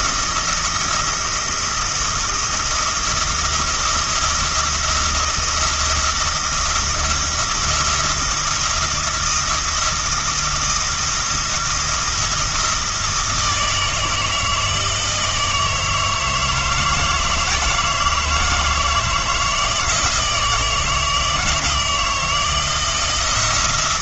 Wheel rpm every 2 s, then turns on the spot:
170, 170, 170, 170, 170, 170, 170, 160, 160, 160, 160, 170.
none